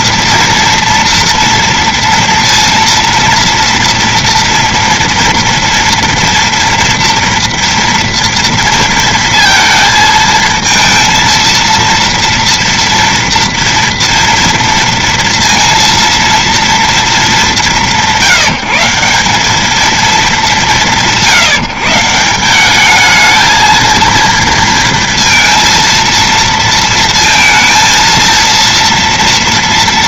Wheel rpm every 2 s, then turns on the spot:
230, 230, 230, 230, 230, 230, 230, 230, 230, 180, 220, 160, 230, 230, 230.
none